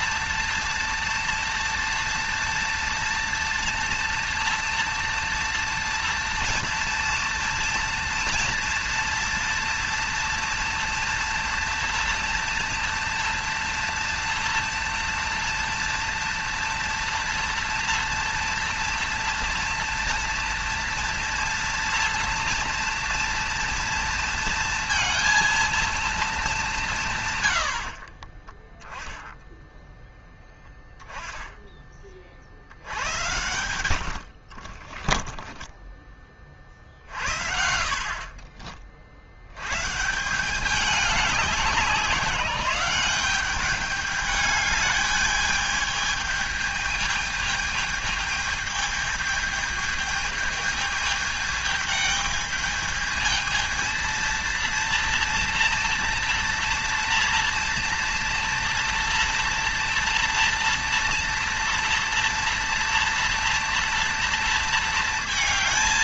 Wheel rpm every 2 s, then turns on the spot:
230, 230, 230, 230, 230, 230, 230, 230, 230, 230, 240, 230, 230, 200, 20, 0, 50, 50, 30, 40, 180, 190, 210, 210, 210, 210, 210, 230, 230, 230, 230, 230, 230.
28-30 34-36 38-40